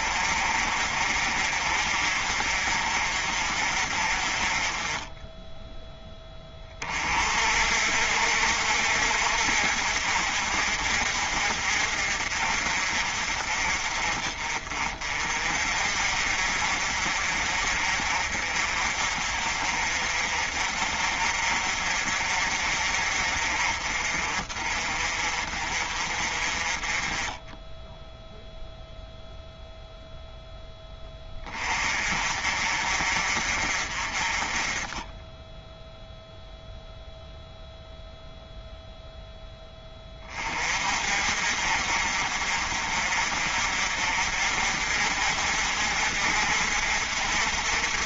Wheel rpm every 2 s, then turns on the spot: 50, 50, 20, 30, 60, 50, 50, 40, 50, 50, 50, 50, 40, 30, 0, 10, 50, 20, 0, 0, 40, 50, 50, 50.
none